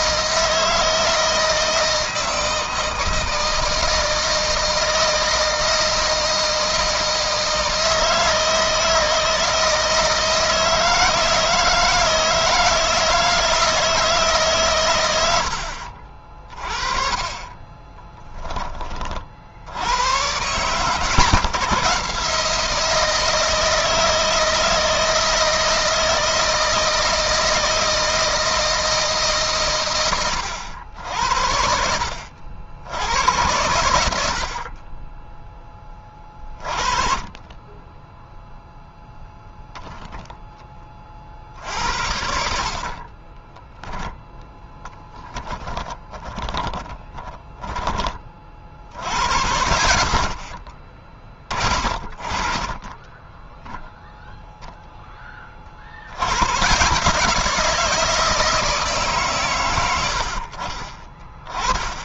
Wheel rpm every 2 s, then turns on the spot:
160, 160, 160, 160, 160, 160, 160, 120, 40, 30, 120, 160, 160, 160, 160, 70, 90, 50, 30, 0, 30, 40, 10, 20, 70, 40, 20, 10, 130, 150, 30.
42-48 52-54